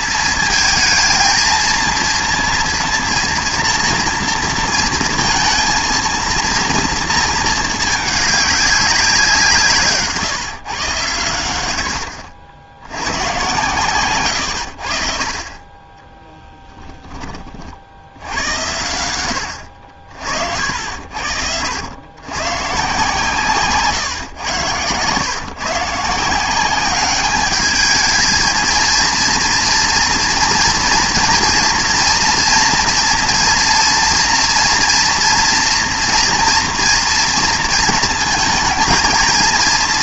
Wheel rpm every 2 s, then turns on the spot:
220, 230, 230, 230, 200, 140, 70, 90, 10, 90, 50, 120, 120, 180, 220, 240, 240, 240, 230, 220.
16-18